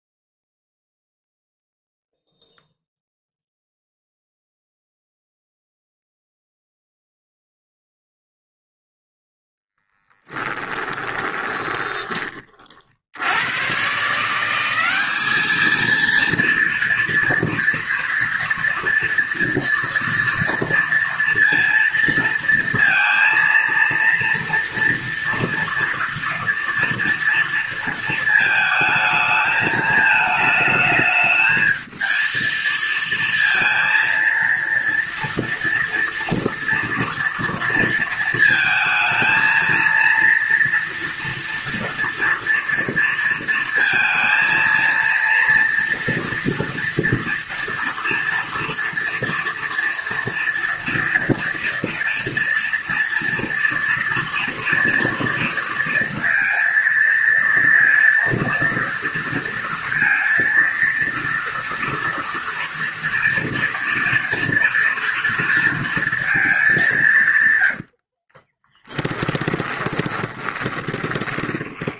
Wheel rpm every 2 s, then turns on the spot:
0, 0, 0, 0, 0, 20, 40, 190, 230, 230, 230, 230, 230, 230, 220, 220, 230, 230, 230, 220, 230, 230, 230, 230, 240, 230, 230, 230, 230, 230, 230, 230, 240, 210, 20, 20.
10-12 68-72